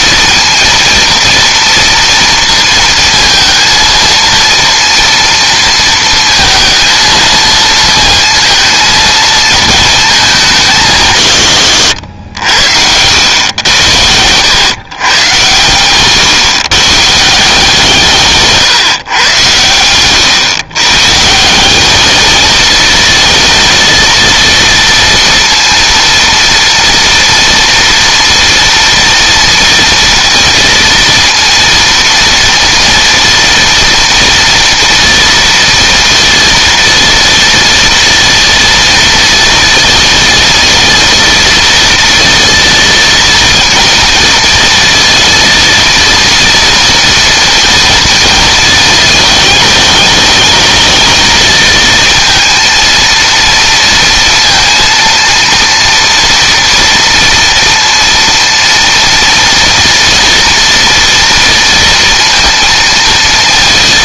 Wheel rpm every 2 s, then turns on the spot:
230, 230, 230, 230, 230, 170, 100, 120, 160, 130, 140, 220, 230, 240, 230, 230, 230, 230, 230, 230, 230, 230, 230, 240, 220, 220, 230, 230, 230, 230, 230, 230.
none